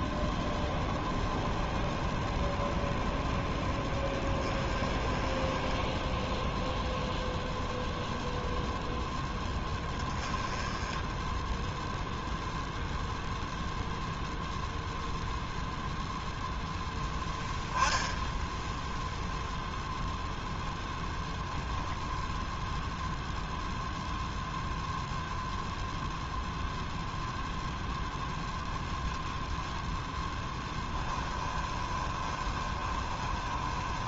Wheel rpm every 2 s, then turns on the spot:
0, 0, 20, 10, 0, 10, 0, 0, 0, 0, 0, 0, 0, 0, 10, 10, 20.
30-34